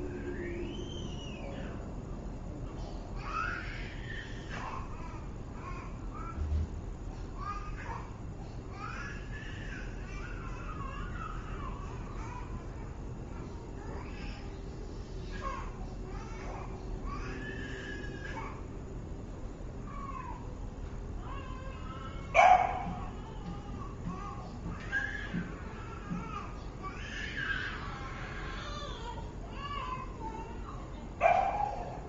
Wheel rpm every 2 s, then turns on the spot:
0, 0, 0, 0, 0, 0, 0, 0, 0, 0, 0, 0, 0, 0, 0, 0.
none